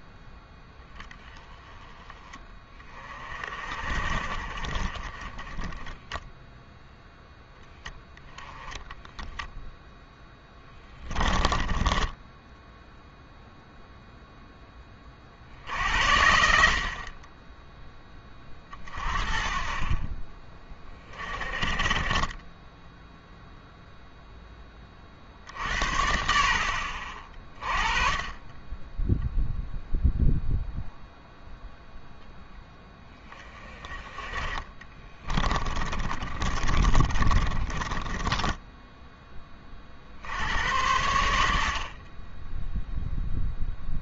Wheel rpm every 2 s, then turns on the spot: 0, 20, 40, 0, 10, 10, 10, 10, 60, 30, 30, 10, 20, 50, 10, 0, 10, 20, 30, 10, 80, 10.
10-12 34-38